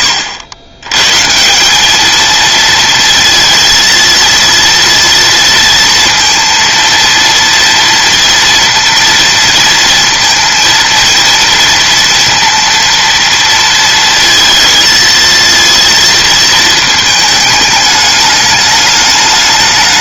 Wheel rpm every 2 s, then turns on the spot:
100, 230, 230, 230, 230, 230, 230, 230, 220, 210.
none